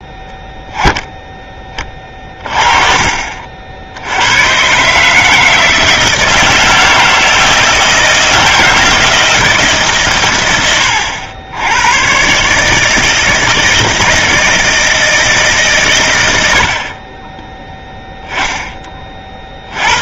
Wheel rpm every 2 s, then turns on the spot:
10, 30, 130, 160, 160, 100, 150, 160, 60, 20.
none